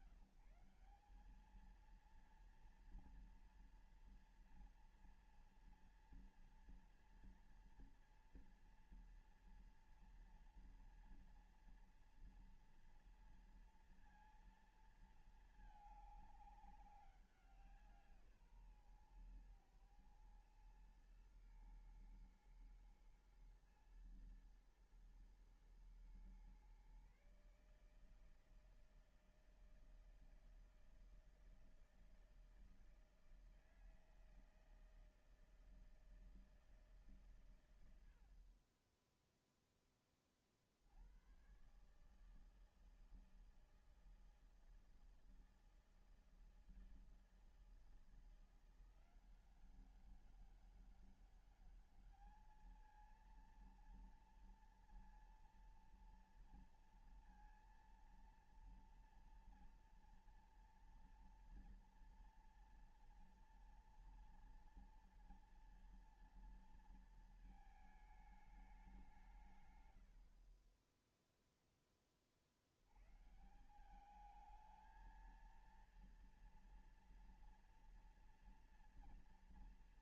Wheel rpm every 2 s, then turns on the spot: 190, 220, 230, 240, 230, 230, 230, 230, 200, 140, 120, 120, 120, 130, 160, 160, 160, 160, 160, 40, 40, 150, 160, 160, 170, 190, 210, 230, 230, 230, 230, 230, 240, 230, 220, 70, 30, 190, 230, 230.
none